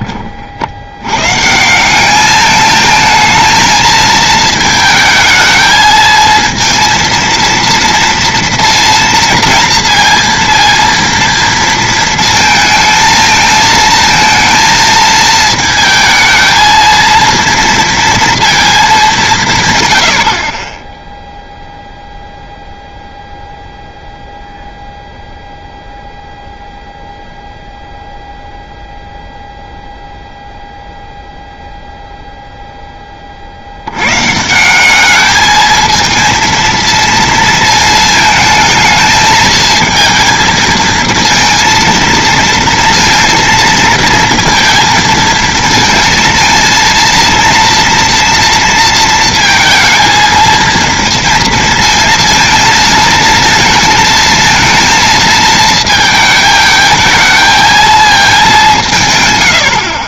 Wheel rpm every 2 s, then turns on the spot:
70, 220, 220, 230, 230, 230, 220, 220, 230, 220, 20, 0, 0, 0, 0, 0, 10, 190, 230, 220, 230, 230, 230, 230, 230, 230, 220, 220, 220, 180.
none